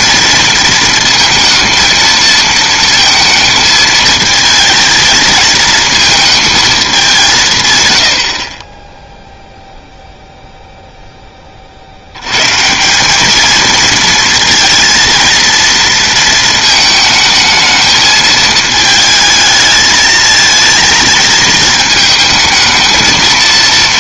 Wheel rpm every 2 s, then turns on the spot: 230, 230, 220, 190, 0, 0, 180, 230, 220, 220, 230, 220.
none